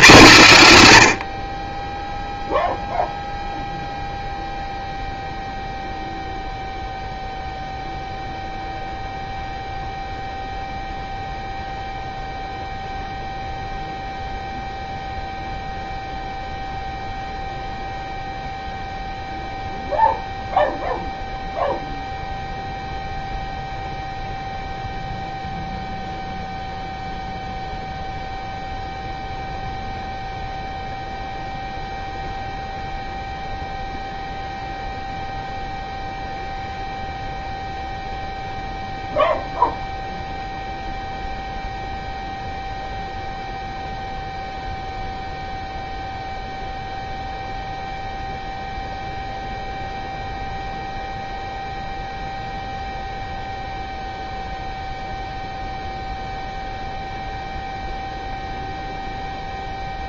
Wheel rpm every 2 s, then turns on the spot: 130, 0, 0, 0, 0, 0, 0, 0, 0, 0, 0, 0, 0, 0, 0, 0, 0, 0, 0, 0, 0, 0, 0, 0, 0, 0, 0, 0, 0, 0.
none